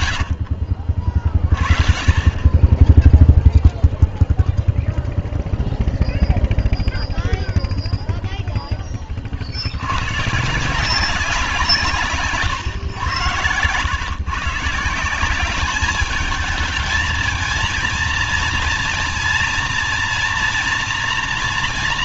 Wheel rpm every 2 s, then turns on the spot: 80, 30, 0, 0, 0, 130, 150, 140, 210, 230, 230.
12-14